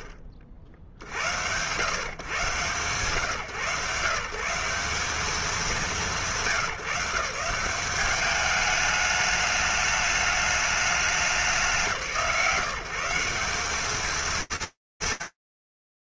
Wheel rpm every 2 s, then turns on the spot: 50, 140, 190, 160, 210, 210, 160, 160.
none